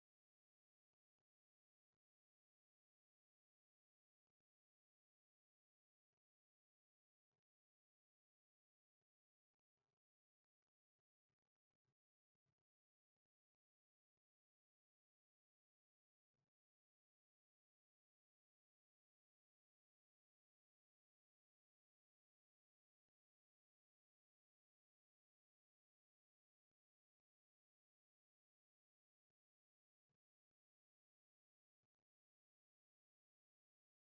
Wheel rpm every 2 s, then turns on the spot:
0, 0, 0, 0, 0, 0, 0, 0, 0, 0, 0, 0, 0, 0, 0, 0, 0.
none